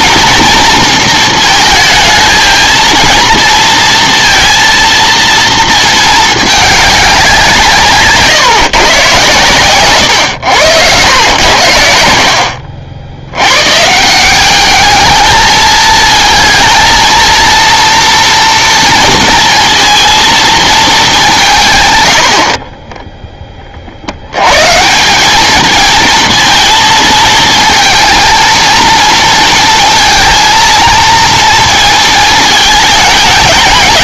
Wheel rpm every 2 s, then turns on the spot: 220, 220, 230, 210, 140, 100, 70, 210, 220, 230, 220, 30, 140, 230, 230, 230, 220.
22-24